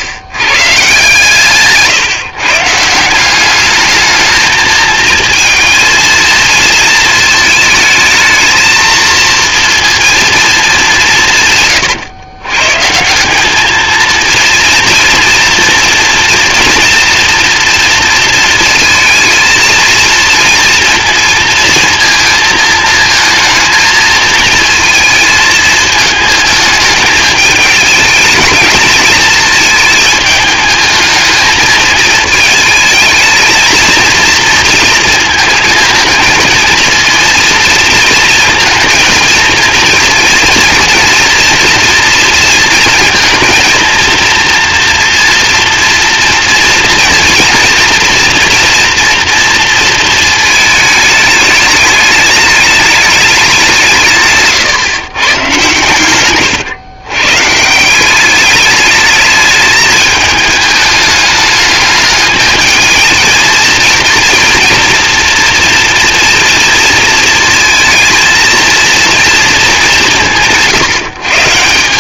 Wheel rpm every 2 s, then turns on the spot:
120, 160, 220, 220, 220, 200, 140, 230, 230, 220, 230, 220, 230, 220, 220, 220, 220, 230, 230, 230, 230, 230, 240, 230, 240, 220, 210, 150, 120, 210, 210, 220, 230, 230, 230, 160.
none